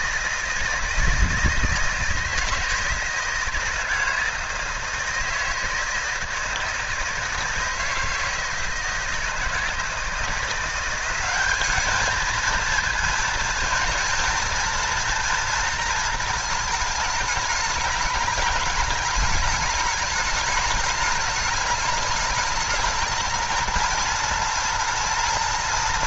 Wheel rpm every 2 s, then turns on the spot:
160, 160, 160, 160, 160, 170, 220, 230, 220, 210, 210, 220, 230.
none